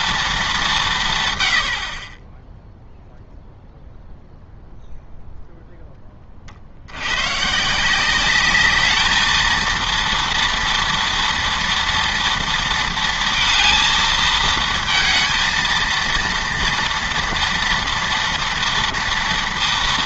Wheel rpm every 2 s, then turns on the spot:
190, 0, 0, 60, 210, 230, 230, 220, 230, 230.
none